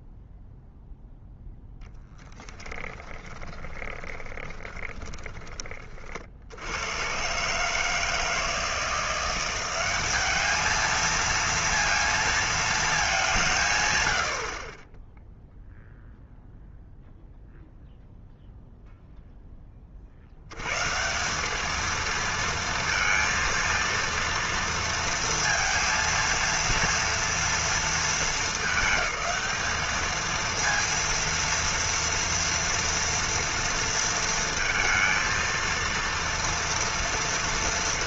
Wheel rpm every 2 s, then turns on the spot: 0, 10, 20, 80, 160, 220, 220, 50, 0, 0, 110, 230, 230, 230, 210, 230, 230, 230, 230.
2-6